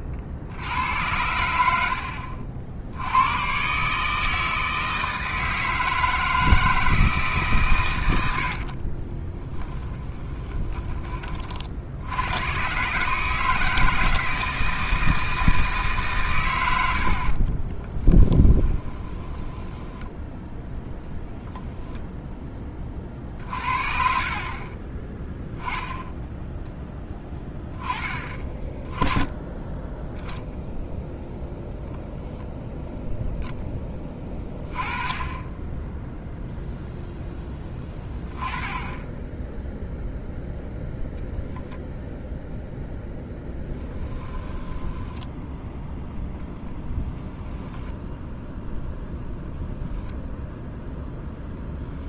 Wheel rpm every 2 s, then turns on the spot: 80, 80, 160, 160, 50, 20, 120, 160, 80, 20, 10, 20, 20, 10, 20, 10, 0, 20, 0, 10, 0, 0, 10, 10, 0, 0.
8-12 18-20 44-48